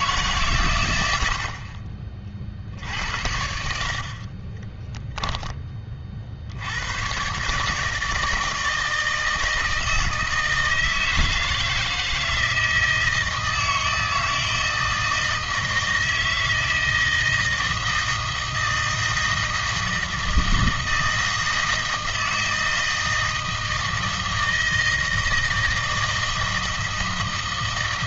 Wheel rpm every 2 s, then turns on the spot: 130, 60, 10, 80, 160, 160, 160, 160, 160, 160, 160, 160, 160, 160.
4-6